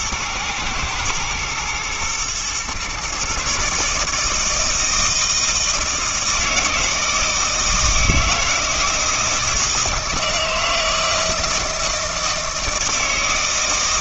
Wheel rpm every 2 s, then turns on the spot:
120, 130, 160, 160, 160, 160, 160.
none